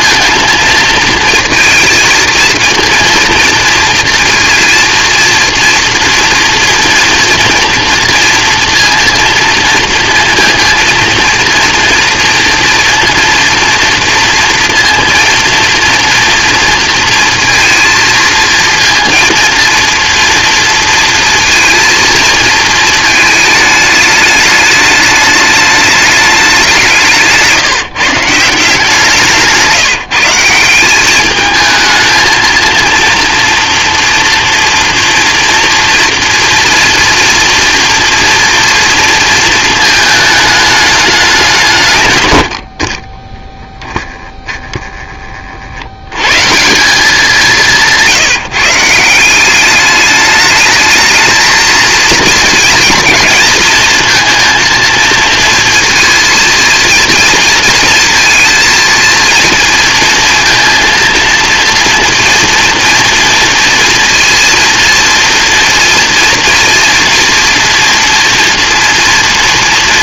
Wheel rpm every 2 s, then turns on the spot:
230, 230, 230, 230, 230, 230, 230, 230, 230, 230, 230, 220, 210, 170, 170, 190, 230, 240, 240, 230, 210, 50, 10, 180, 160, 220, 230, 230, 230, 220, 230, 230, 230, 230, 230.
none